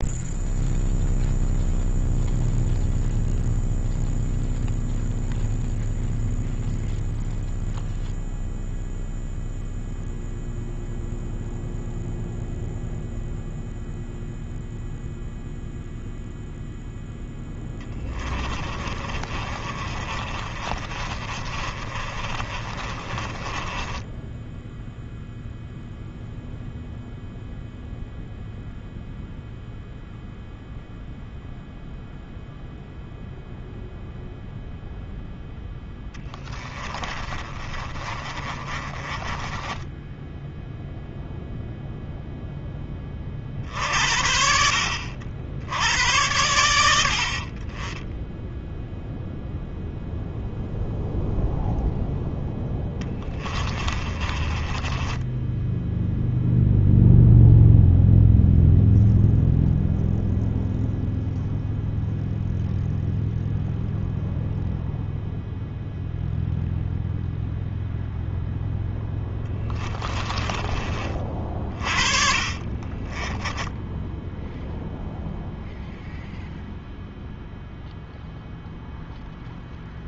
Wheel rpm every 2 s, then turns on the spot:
0, 0, 0, 0, 0, 0, 0, 0, 0, 20, 40, 30, 10, 0, 0, 0, 0, 0, 20, 30, 0, 10, 70, 90, 10, 0, 10, 20, 0, 0, 0, 0, 0, 0, 0, 30, 30, 0, 0, 0.
18-26 36-40 52-56 72-74